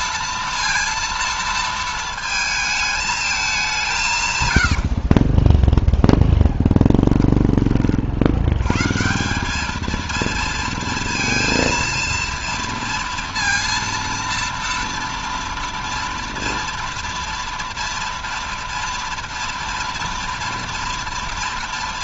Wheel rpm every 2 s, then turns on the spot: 230, 220, 100, 10, 100, 230, 230, 230, 230, 230, 230.
4-8